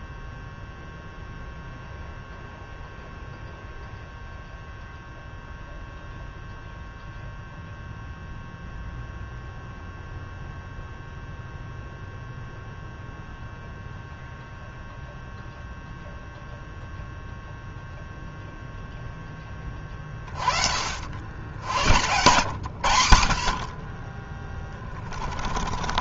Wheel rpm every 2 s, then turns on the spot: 0, 0, 0, 0, 0, 0, 0, 0, 0, 0, 30, 100, 30.
none